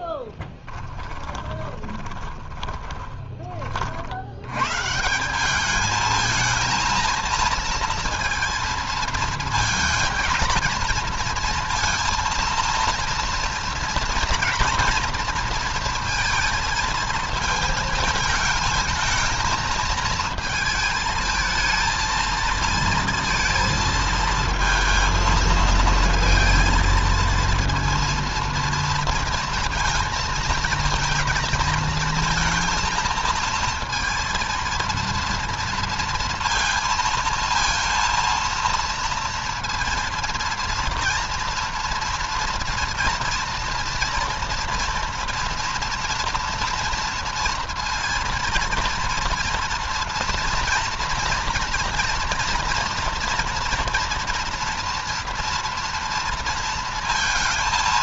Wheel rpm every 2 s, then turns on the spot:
20, 20, 140, 220, 230, 220, 230, 230, 220, 220, 220, 230, 220, 230, 230, 230, 230, 230, 230, 230, 230, 230, 230, 230, 230, 230, 230, 230, 230.
0-4